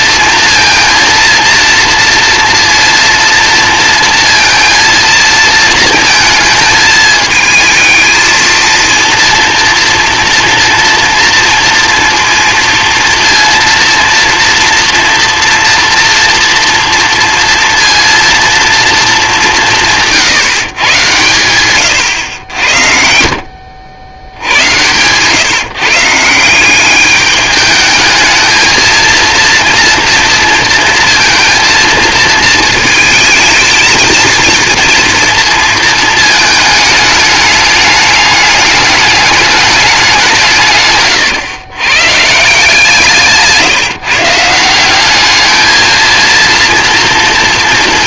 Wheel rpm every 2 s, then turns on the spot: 230, 230, 230, 220, 230, 230, 230, 230, 240, 230, 130, 70, 90, 180, 220, 230, 230, 230, 220, 200, 140, 170, 180, 230.
none